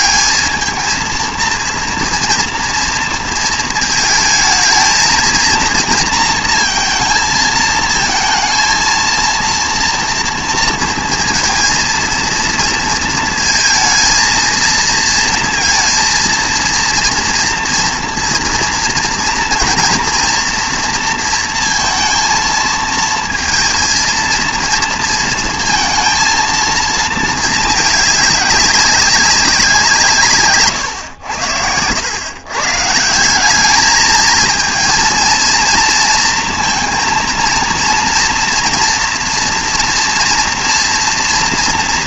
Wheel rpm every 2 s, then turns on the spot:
220, 230, 220, 230, 230, 230, 230, 220, 230, 240, 240, 220, 230, 230, 200, 120, 140, 220, 230, 230, 230.
30-32